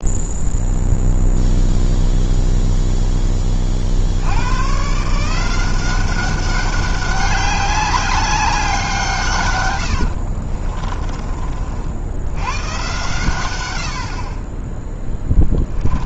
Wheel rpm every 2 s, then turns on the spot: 0, 0, 140, 200, 170, 30, 120, 10.
10-12 14-16